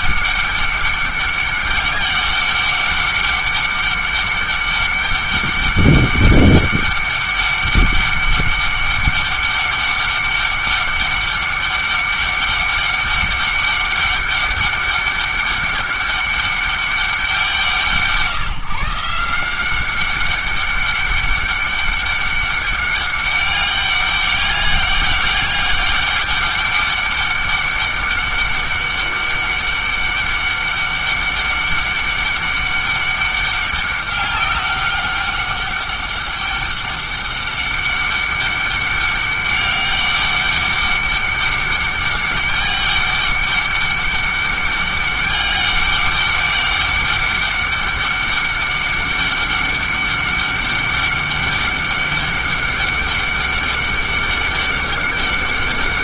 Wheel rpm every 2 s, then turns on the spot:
200, 200, 200, 200, 200, 200, 200, 200, 200, 160, 200, 200, 200, 200, 200, 200, 200, 200, 200, 200, 200, 200, 200, 200, 200, 200, 200, 200.
none